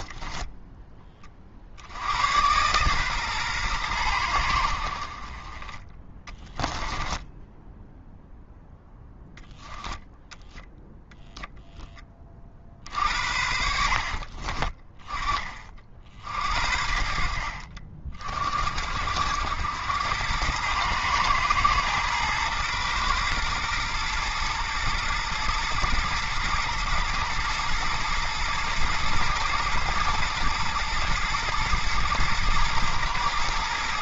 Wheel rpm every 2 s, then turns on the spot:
10, 130, 50, 20, 0, 10, 50, 30, 60, 60, 110, 110, 110, 110, 120, 120, 110.
6-8